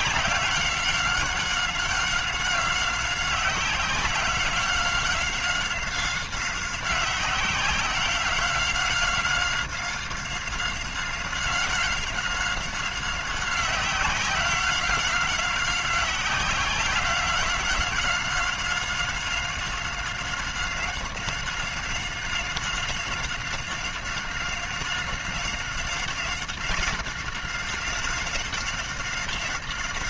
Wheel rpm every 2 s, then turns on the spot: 190, 190, 190, 190, 190, 190, 190, 190, 190, 190, 190, 190, 190, 190, 190.
none